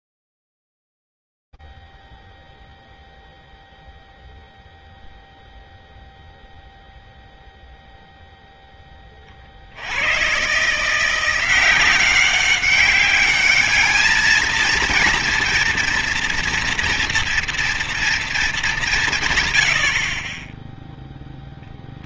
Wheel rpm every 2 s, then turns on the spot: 0, 0, 0, 0, 0, 110, 190, 220, 230, 230, 40.
none